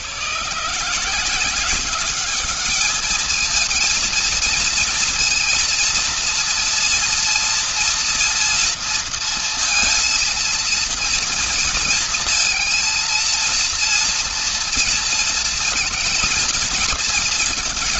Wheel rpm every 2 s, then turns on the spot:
140, 210, 230, 230, 230, 230, 230, 230, 230.
none